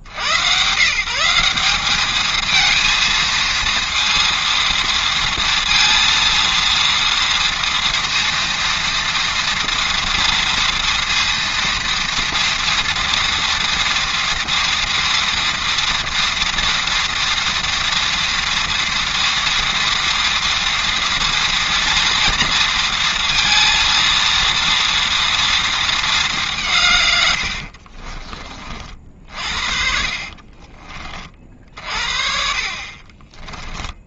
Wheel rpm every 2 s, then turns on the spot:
70, 220, 230, 230, 230, 230, 230, 230, 230, 230, 230, 230, 230, 190, 40, 50, 50.
30-32